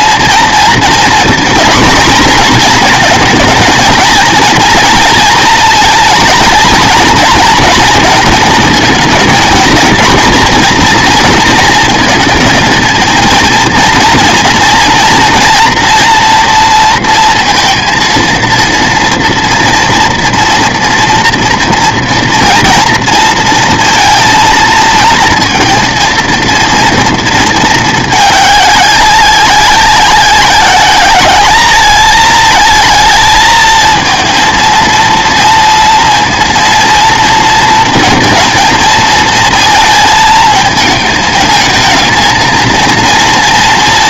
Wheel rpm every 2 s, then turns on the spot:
230, 220, 230, 220, 230, 230, 230, 230, 230, 230, 230, 230, 220, 230, 200, 190, 220, 230, 230, 230, 220, 230.
none